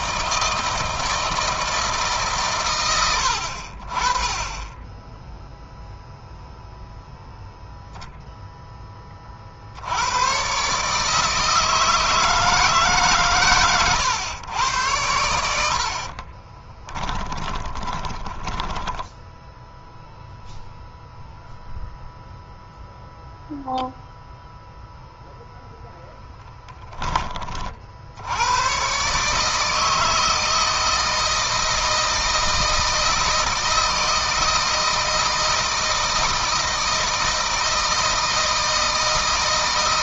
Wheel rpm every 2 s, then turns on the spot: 160, 120, 10, 0, 10, 130, 160, 100, 20, 10, 0, 0, 0, 10, 110, 160, 160, 160, 160, 160.
16-20